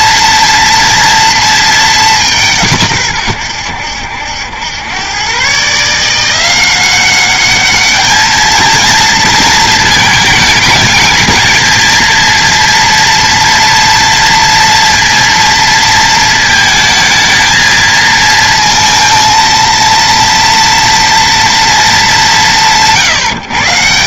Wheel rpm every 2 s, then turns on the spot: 230, 150, 100, 180, 220, 220, 230, 230, 220, 230, 230, 170.
none